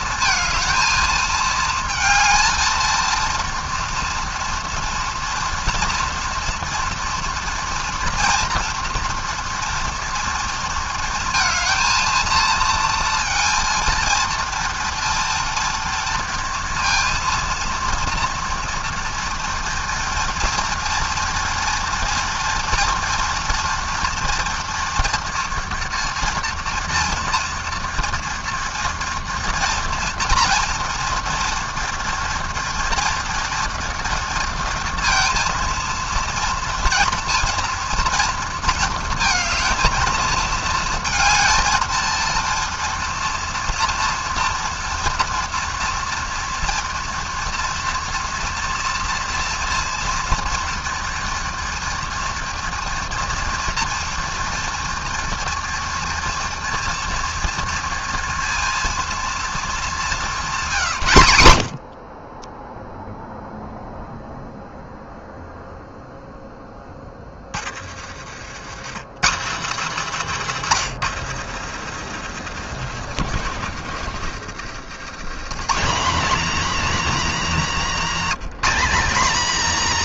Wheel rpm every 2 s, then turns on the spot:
230, 230, 230, 230, 230, 230, 230, 230, 230, 230, 230, 230, 240, 230, 230, 230, 230, 230, 230, 230, 220, 230, 240, 230, 230, 230, 230, 230, 240, 230, 190, 10, 0, 10, 120, 240, 160, 100, 280, 250.
72-76